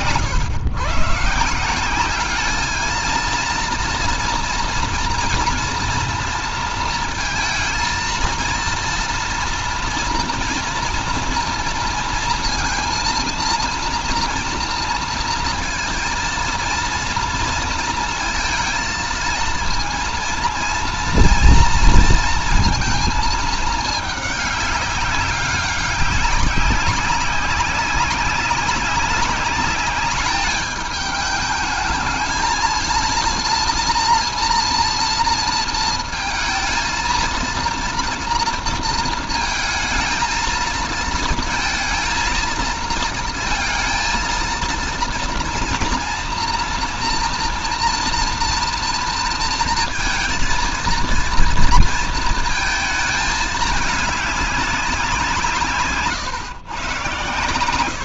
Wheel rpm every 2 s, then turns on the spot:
130, 210, 230, 230, 230, 230, 230, 230, 230, 230, 230, 230, 210, 200, 190, 210, 220, 230, 220, 230, 220, 220, 230, 230, 230, 230, 230, 200, 120.
none